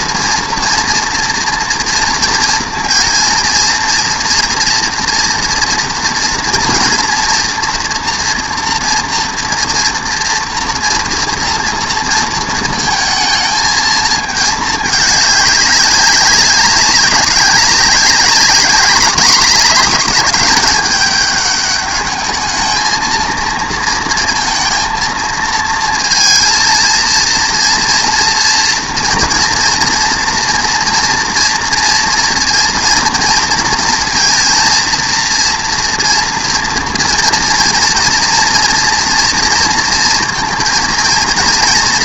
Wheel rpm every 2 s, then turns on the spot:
230, 230, 230, 240, 230, 230, 230, 220, 190, 200, 220, 220, 230, 230, 230, 230, 230, 230, 230, 230, 230.
none